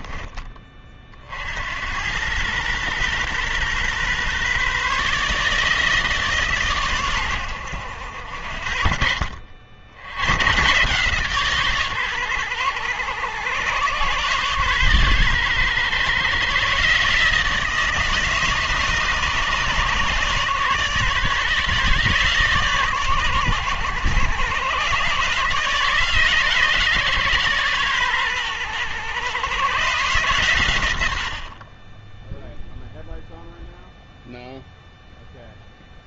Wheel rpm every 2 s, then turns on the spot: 40, 120, 150, 120, 60, 130, 100, 120, 150, 140, 140, 130, 130, 140, 110, 100, 0, 0.
none